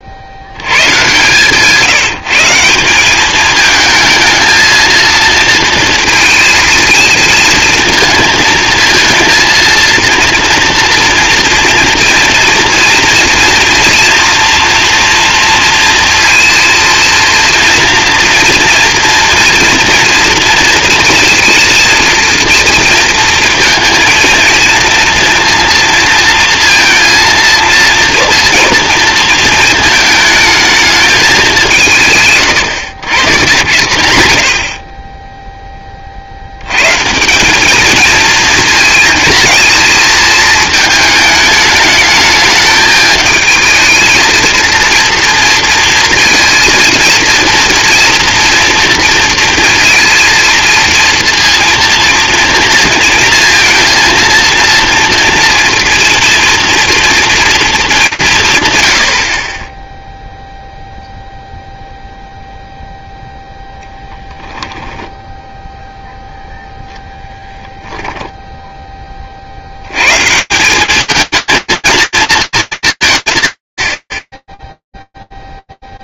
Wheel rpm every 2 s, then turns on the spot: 140, 200, 230, 220, 230, 230, 230, 240, 230, 230, 230, 230, 230, 230, 230, 210, 120, 20, 130, 220, 220, 220, 230, 230, 230, 230, 230, 240, 230, 90, 0, 0, 0, 10, 60, 230, 220, 20.
34-36